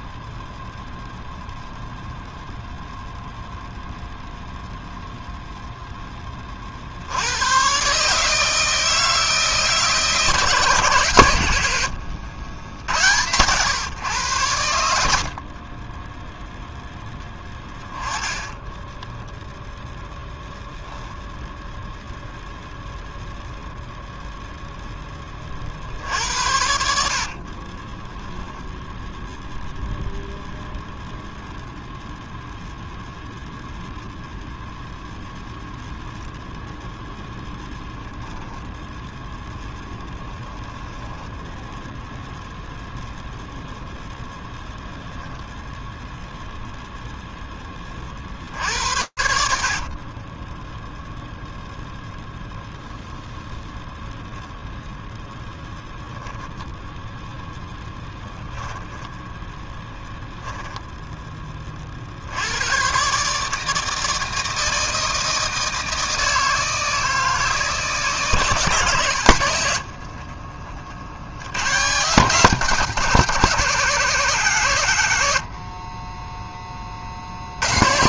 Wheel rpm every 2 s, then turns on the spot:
0, 0, 0, 40, 160, 150, 90, 90, 0, 10, 0, 0, 0, 60, 0, 0, 0, 0, 0, 0, 10, 0, 0, 0, 70, 0, 0, 0, 10, 10, 10, 140, 160, 160, 100, 80, 160, 80, 60.
18-20 26-28 40-42 58-60